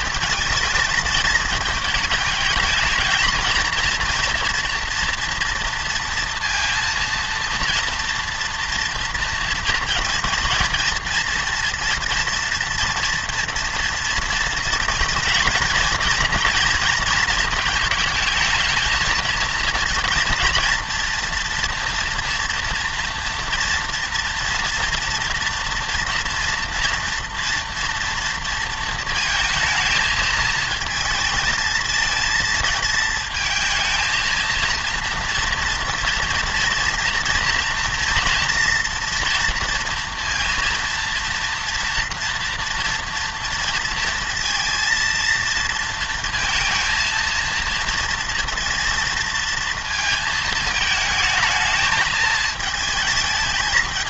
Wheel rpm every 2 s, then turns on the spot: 220, 220, 230, 230, 230, 230, 230, 230, 230, 220, 230, 230, 230, 230, 230, 220, 230, 230, 240, 230, 230, 230, 230, 230, 230, 220, 220.
none